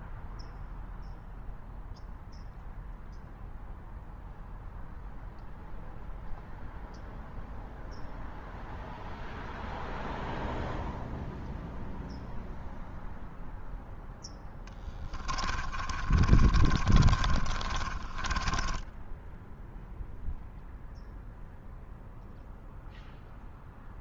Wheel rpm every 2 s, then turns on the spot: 0, 0, 0, 0, 0, 0, 0, 10, 40, 10, 0, 0.
14-20